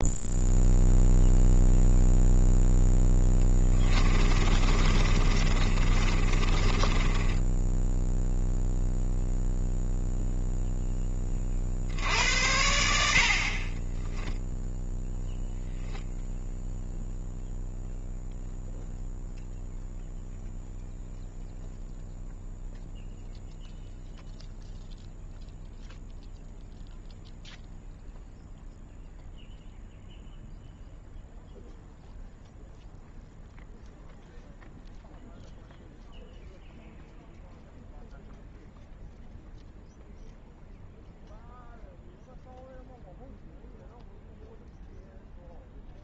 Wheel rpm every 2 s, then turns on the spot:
0, 0, 30, 30, 0, 0, 80, 0, 0, 0, 0, 0, 0, 0, 0, 0, 0, 0, 0, 0, 0, 0, 0.
4-8